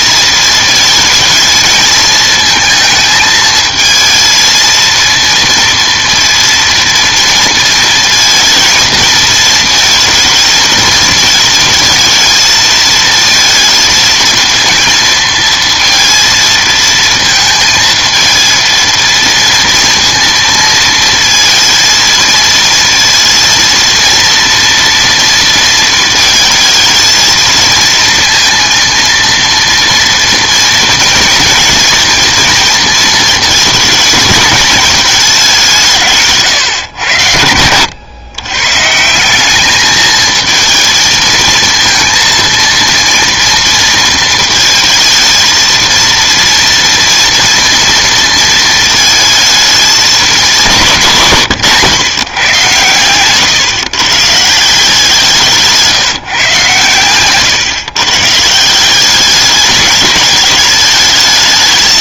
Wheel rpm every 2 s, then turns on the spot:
220, 220, 230, 230, 230, 220, 220, 230, 230, 230, 230, 230, 230, 220, 230, 230, 230, 210, 120, 130, 230, 230, 230, 230, 220, 180, 120, 170, 130, 170, 220.
none